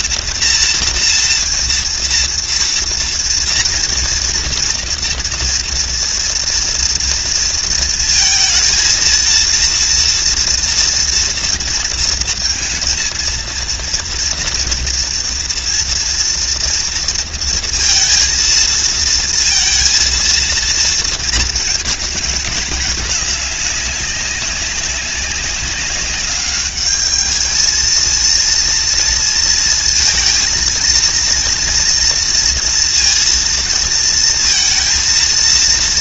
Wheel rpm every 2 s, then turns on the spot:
230, 240, 230, 230, 230, 230, 230, 230, 230, 230, 220, 210, 200, 210, 230, 230, 230, 230.
none